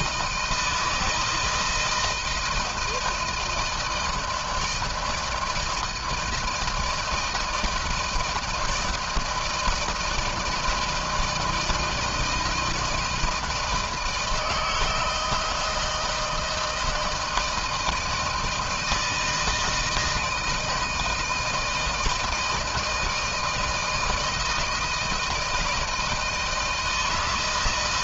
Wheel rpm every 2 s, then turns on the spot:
160, 160, 160, 160, 160, 160, 160, 160, 160, 160, 160, 160, 160, 170.
none